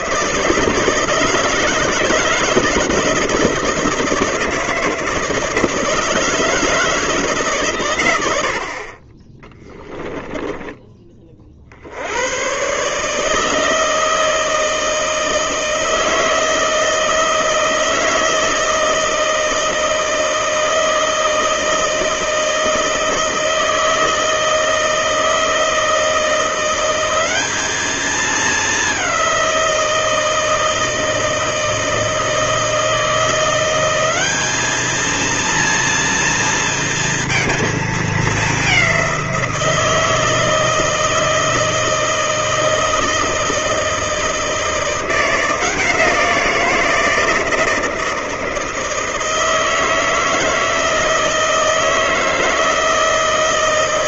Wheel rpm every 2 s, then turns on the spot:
160, 160, 160, 160, 80, 10, 110, 160, 160, 160, 160, 160, 160, 170, 210, 160, 160, 200, 230, 200, 160, 160, 160, 170, 160, 160, 160.
none